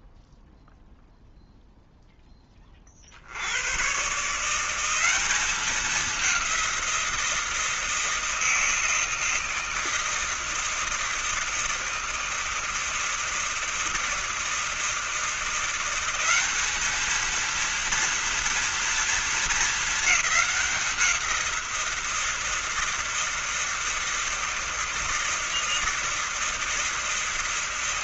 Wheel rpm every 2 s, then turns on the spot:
0, 40, 180, 180, 160, 160, 160, 160, 210, 230, 180, 160, 160, 160.
none